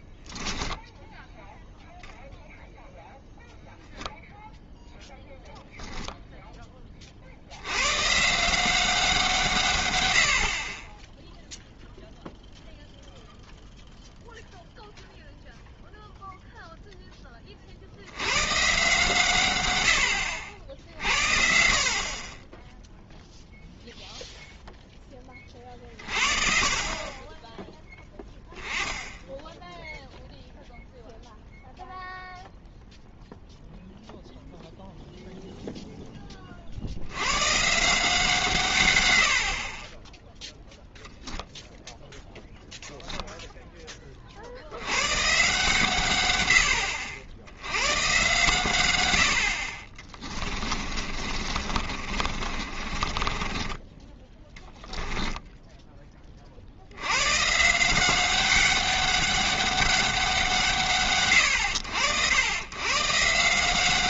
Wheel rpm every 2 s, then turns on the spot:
10, 0, 0, 10, 170, 40, 0, 0, 0, 130, 60, 10, 0, 40, 10, 0, 0, 0, 50, 130, 0, 0, 80, 90, 110, 20, 40, 10, 60, 190, 160, 110.
0-2 50-56